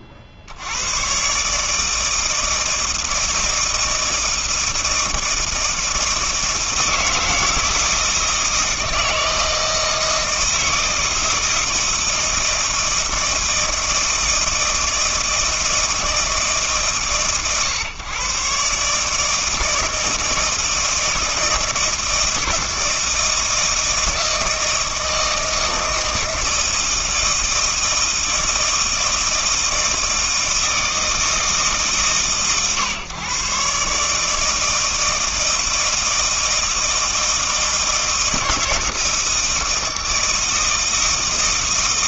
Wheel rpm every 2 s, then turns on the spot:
60, 160, 160, 160, 160, 160, 160, 160, 140, 140, 160, 160, 160, 160, 160, 160, 130, 160, 160, 160, 160.
none